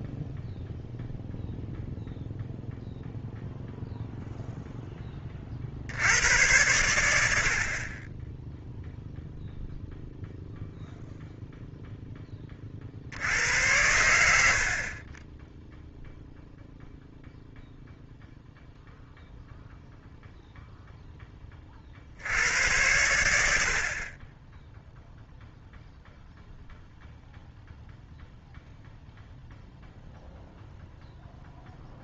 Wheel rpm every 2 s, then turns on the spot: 0, 0, 10, 90, 0, 0, 50, 40, 0, 0, 0, 90, 0, 0, 0, 10.
none